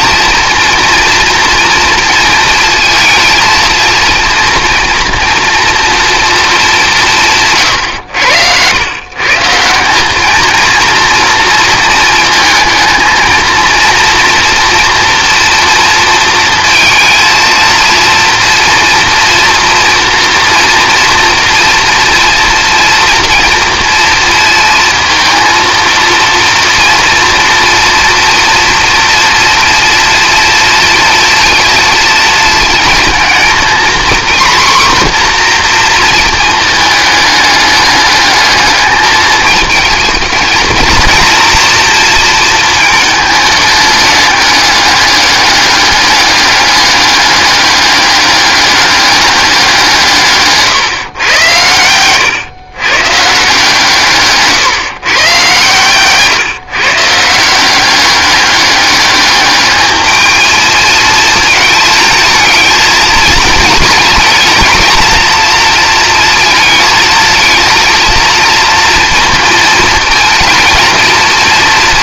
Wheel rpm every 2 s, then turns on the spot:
240, 230, 230, 200, 110, 230, 220, 230, 230, 230, 230, 240, 230, 230, 230, 230, 220, 250, 220, 210, 230, 220, 210, 200, 200, 140, 130, 130, 150, 200, 220, 220, 230, 220, 230, 230.
none